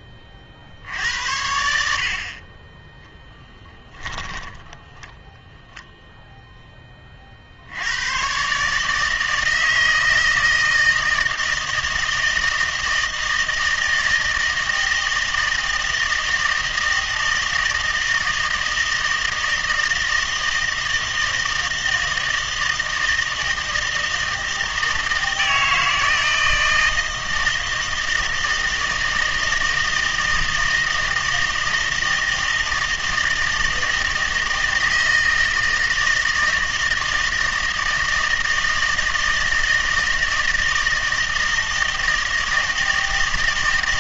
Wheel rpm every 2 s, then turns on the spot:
60, 20, 20, 10, 150, 160, 160, 160, 160, 160, 160, 160, 160, 160, 160, 160, 160, 160, 160, 160, 160, 160.
4-6